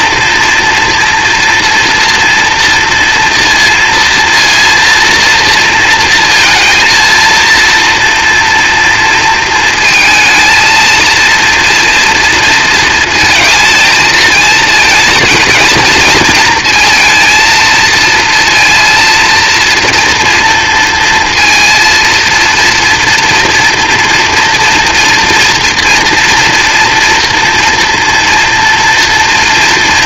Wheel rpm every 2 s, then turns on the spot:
230, 240, 230, 230, 230, 230, 230, 220, 230, 230, 230, 230, 240, 230, 230.
none